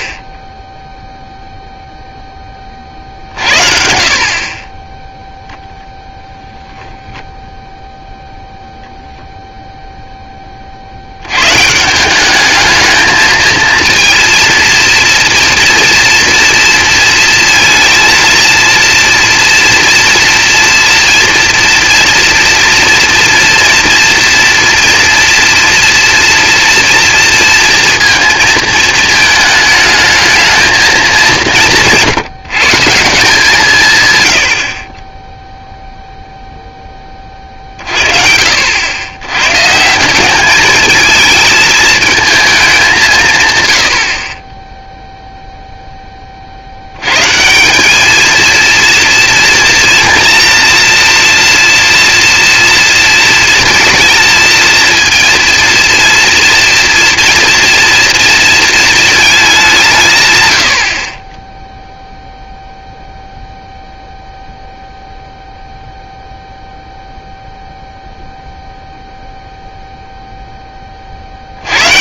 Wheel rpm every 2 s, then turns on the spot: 20, 40, 20, 0, 0, 130, 220, 230, 230, 230, 230, 230, 230, 230, 220, 180, 170, 0, 30, 110, 220, 150, 0, 120, 230, 230, 230, 230, 230, 220, 40, 0, 0, 0, 0, 20.
none